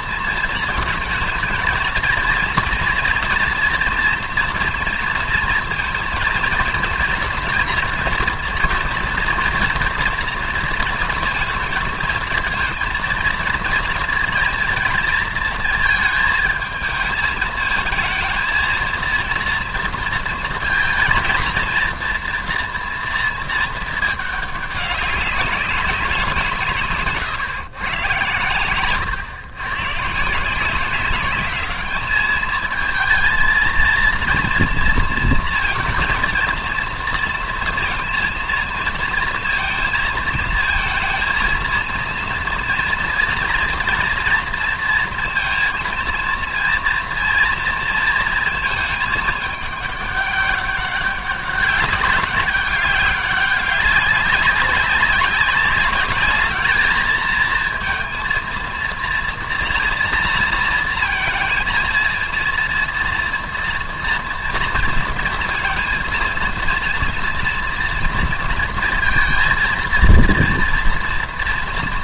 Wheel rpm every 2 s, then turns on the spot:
220, 230, 230, 230, 230, 230, 230, 230, 220, 230, 230, 230, 200, 140, 120, 190, 220, 230, 230, 230, 220, 230, 230, 230, 220, 200, 200, 200, 220, 240, 230, 230, 230, 230, 230, 230.
26-28